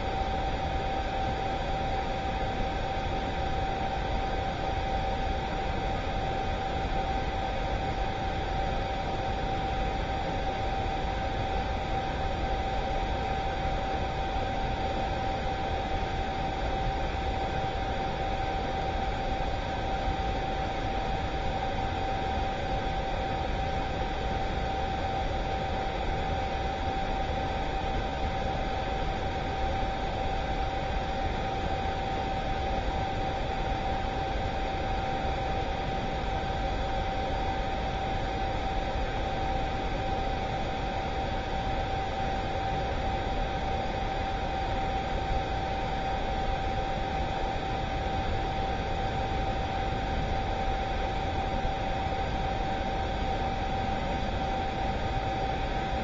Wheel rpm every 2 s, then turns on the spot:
0, 0, 0, 0, 0, 0, 0, 0, 0, 0, 0, 0, 0, 0, 0, 0, 0, 0, 0, 0, 0, 0, 0, 0, 0, 0, 0, 0.
none